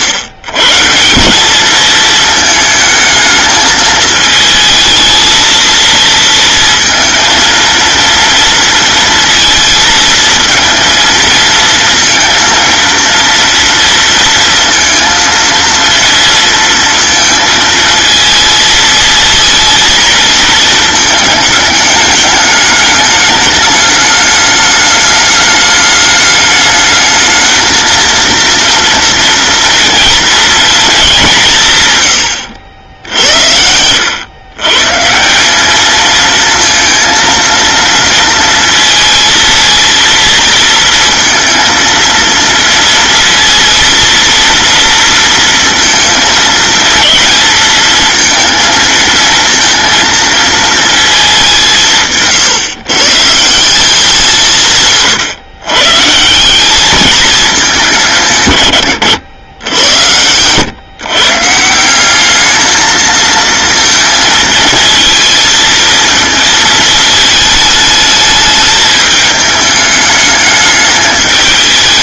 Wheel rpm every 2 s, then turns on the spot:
130, 220, 220, 230, 230, 230, 230, 230, 230, 220, 220, 210, 210, 210, 230, 220, 70, 130, 230, 230, 230, 230, 230, 220, 230, 230, 140, 160, 190, 120, 120, 220, 230, 220, 220, 210.
32-34